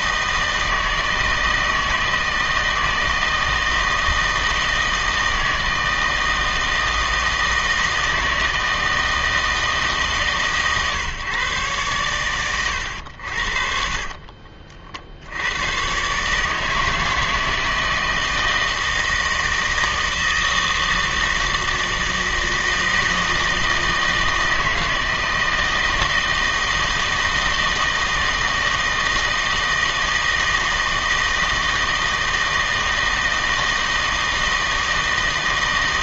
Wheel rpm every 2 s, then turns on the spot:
160, 160, 160, 160, 160, 140, 90, 60, 160, 160, 160, 160, 160, 160, 160, 160, 160, 160.
none